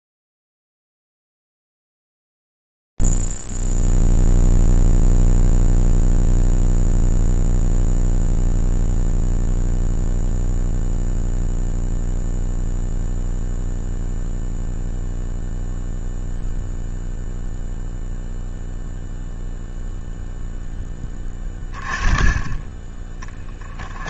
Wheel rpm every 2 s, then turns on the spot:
0, 0, 0, 0, 0, 0, 0, 0, 0, 0, 0, 20.
none